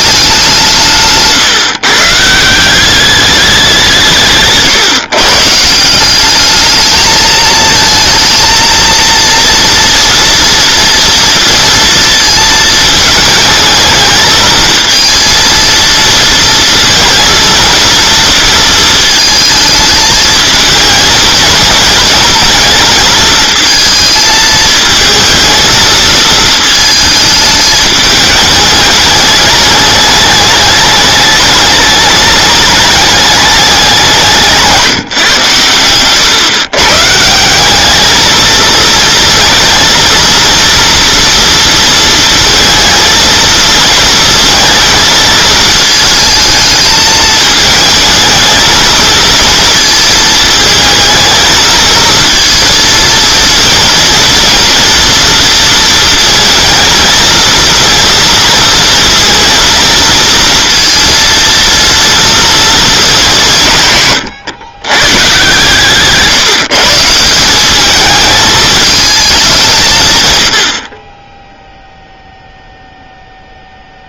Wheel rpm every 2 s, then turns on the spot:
170, 180, 150, 210, 230, 240, 220, 220, 230, 230, 220, 220, 220, 220, 210, 210, 210, 170, 130, 220, 230, 230, 230, 220, 220, 220, 230, 230, 230, 230, 230, 230, 130, 160, 220, 70, 0.
none